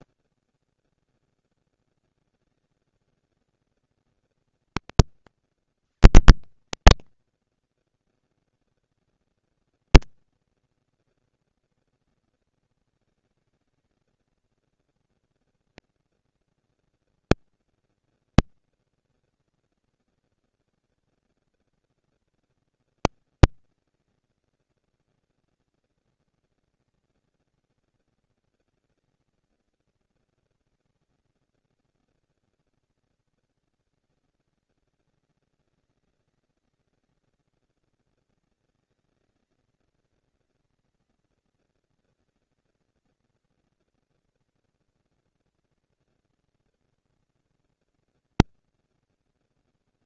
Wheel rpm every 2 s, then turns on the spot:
190, 200, 220, 190, 150, 230, 230, 230, 230, 230, 230, 230, 230, 230, 230, 230, 230, 200, 190, 210, 230, 220, 230, 230, 230.
none